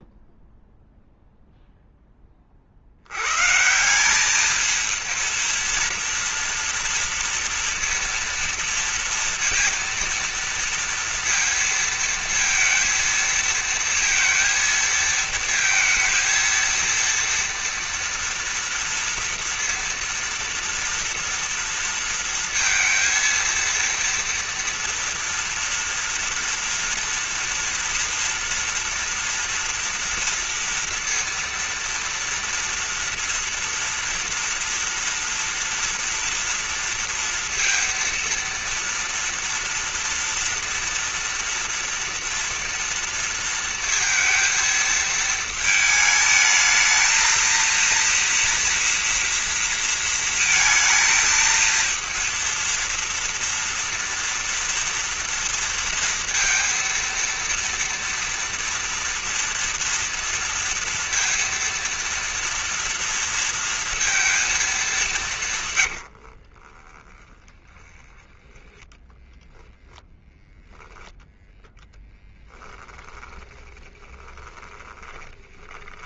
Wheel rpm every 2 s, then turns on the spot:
0, 20, 200, 230, 230, 230, 230, 220, 230, 230, 230, 230, 230, 230, 230, 230, 230, 230, 230, 230, 230, 240, 230, 220, 230, 230, 230, 230, 230, 230, 230, 230, 230, 90, 10, 0, 10, 20.
66-68 72-76